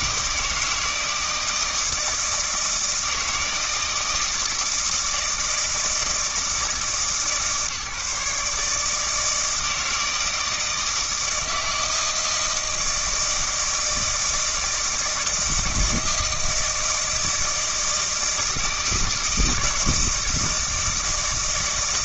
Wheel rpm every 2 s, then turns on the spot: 160, 160, 160, 160, 150, 160, 160, 160, 160, 160, 160.
none